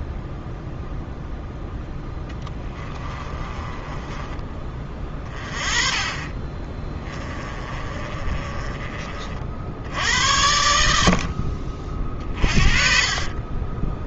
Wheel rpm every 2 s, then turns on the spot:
0, 20, 30, 20, 30, 70, 30.
2-4 6-8 10-14